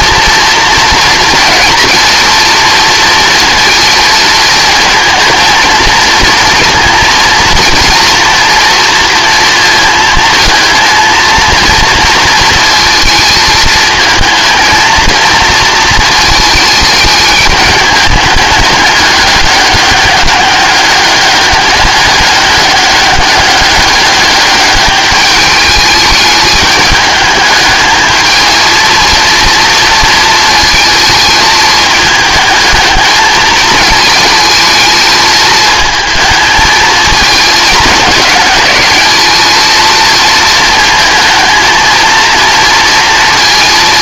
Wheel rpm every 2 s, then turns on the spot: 230, 230, 230, 230, 230, 230, 230, 220, 220, 210, 200, 200, 210, 210, 220, 230, 220, 220, 220, 210, 220, 230.
none